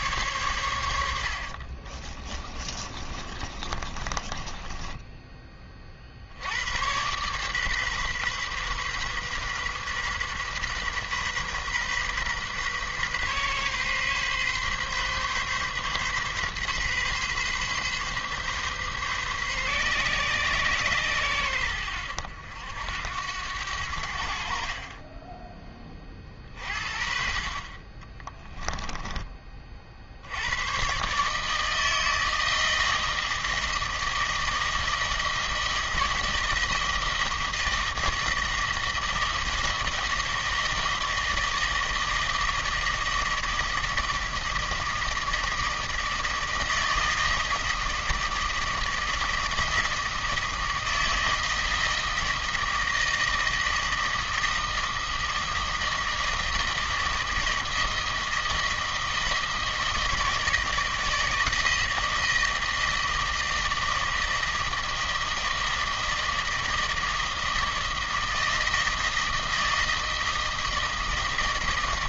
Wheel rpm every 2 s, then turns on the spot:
80, 30, 10, 110, 130, 130, 130, 130, 130, 130, 120, 80, 30, 50, 20, 130, 160, 160, 160, 160, 160, 160, 160, 160, 160, 160, 160, 160, 160, 160, 160, 160, 160, 160, 160, 160.
2-6 24-26